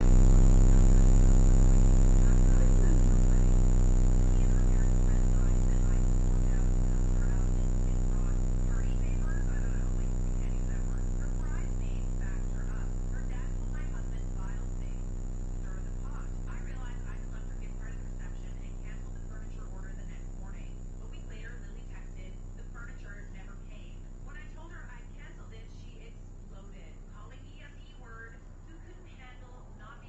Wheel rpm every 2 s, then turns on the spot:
0, 0, 0, 0, 0, 0, 0, 0, 0, 0, 0, 0, 0, 0, 0.
none